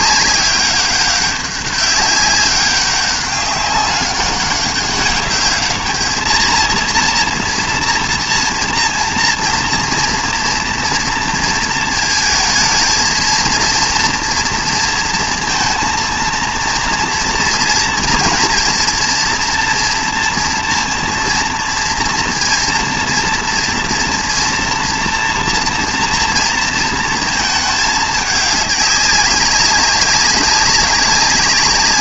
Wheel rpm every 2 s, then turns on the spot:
200, 200, 200, 230, 230, 230, 220, 230, 230, 240, 230, 230, 230, 230, 200, 190.
none